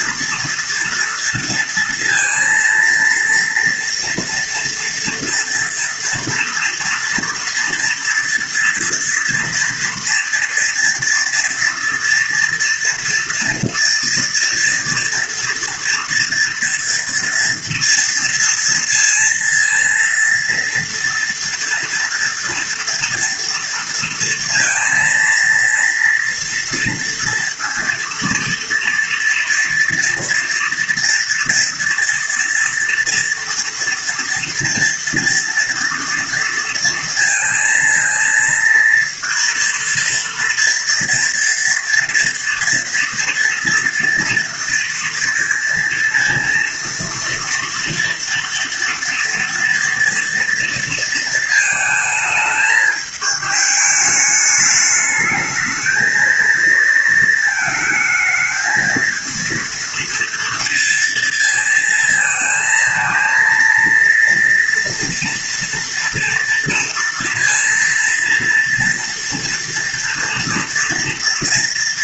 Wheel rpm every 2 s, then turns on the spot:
230, 230, 230, 230, 230, 230, 230, 230, 230, 230, 230, 230, 230, 230, 230, 230, 230, 230, 230, 230, 230, 230, 230, 230, 240, 230, 210, 220, 220, 220, 230, 230, 230, 230, 230, 230.
none